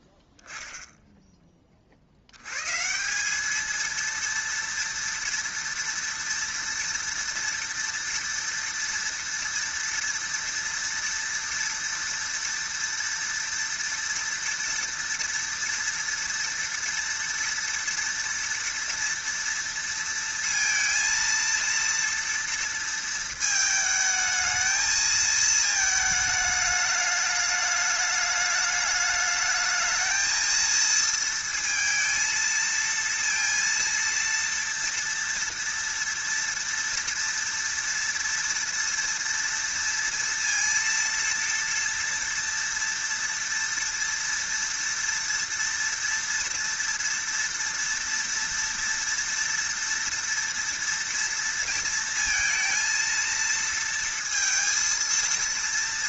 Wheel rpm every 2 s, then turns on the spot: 10, 120, 230, 230, 240, 230, 230, 230, 230, 230, 230, 230, 220, 210, 210, 220, 230, 230, 230, 230, 230, 230, 230, 230, 230, 230, 230, 230.
none